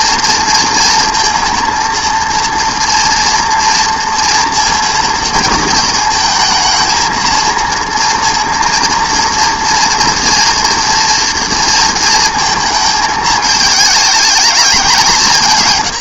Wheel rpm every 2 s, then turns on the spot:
230, 240, 230, 220, 230, 230, 220, 210.
none